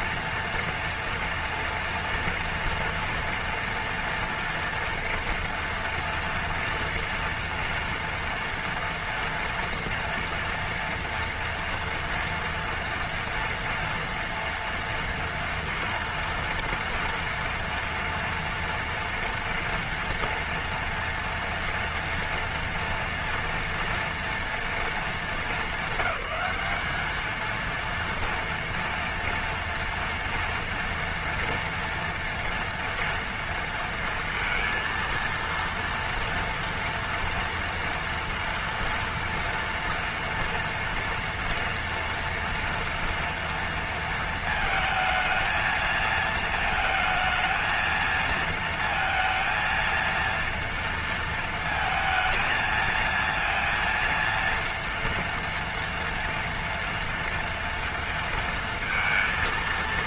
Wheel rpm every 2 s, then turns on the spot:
240, 230, 240, 240, 230, 230, 230, 230, 230, 230, 230, 230, 220, 210, 230, 230, 240, 230, 230, 230, 230, 240, 230, 220, 230, 230, 230, 230, 230, 230.
none